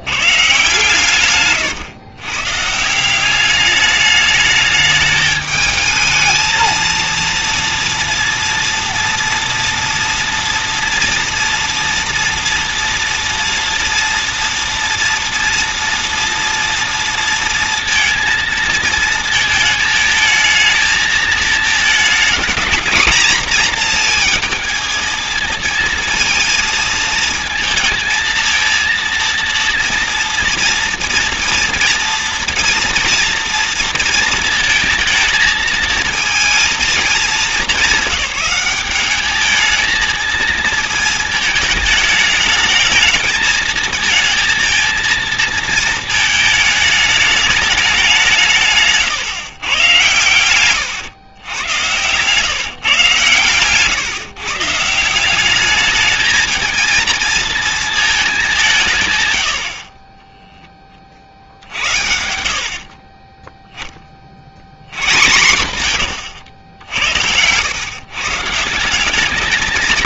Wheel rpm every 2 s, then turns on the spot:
140, 130, 210, 220, 230, 240, 240, 230, 230, 230, 220, 220, 230, 230, 230, 230, 230, 230, 230, 200, 220, 220, 230, 220, 150, 110, 140, 150, 230, 200, 10, 60, 70, 100, 150.
62-64 66-68